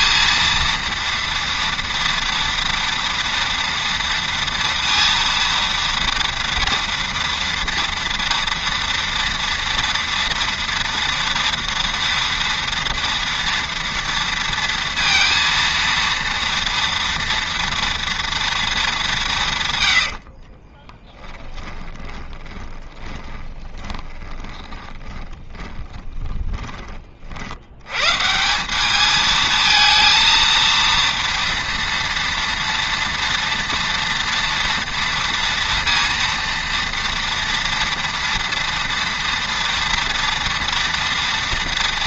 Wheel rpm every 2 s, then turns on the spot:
230, 230, 230, 230, 230, 230, 230, 230, 230, 230, 40, 20, 20, 20, 170, 230, 230, 230, 230, 230, 230.
20-26